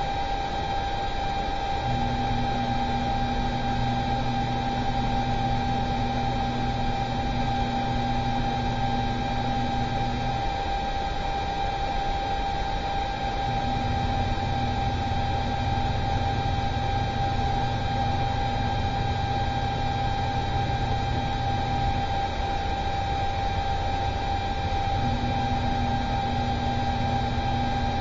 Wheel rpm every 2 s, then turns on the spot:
0, 0, 0, 0, 0, 0, 0, 0, 0, 0, 0, 0, 0, 0.
none